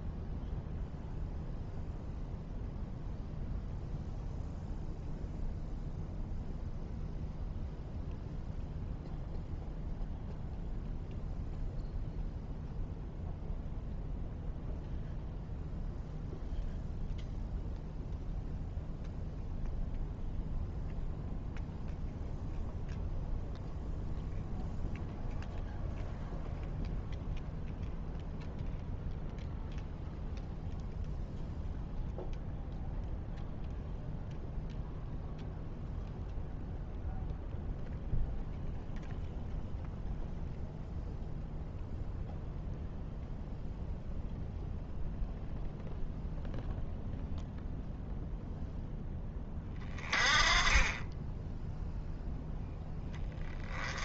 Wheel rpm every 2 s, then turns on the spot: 0, 0, 0, 0, 0, 0, 0, 0, 0, 0, 0, 0, 0, 0, 0, 0, 0, 0, 0, 0, 0, 0, 0, 0, 0, 20, 10.
none